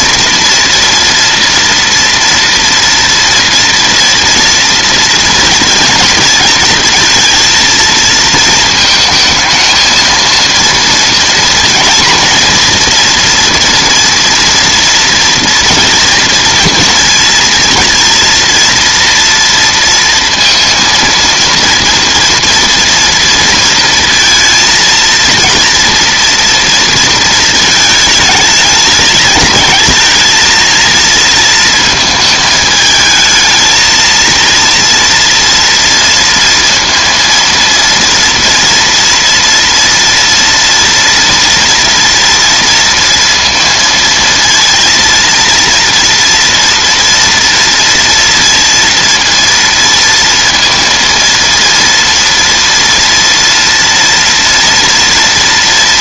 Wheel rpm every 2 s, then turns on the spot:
230, 230, 230, 230, 220, 230, 230, 240, 230, 230, 230, 230, 230, 230, 210, 230, 220, 230, 230, 230, 230, 230, 230, 230, 230, 230, 230, 230.
none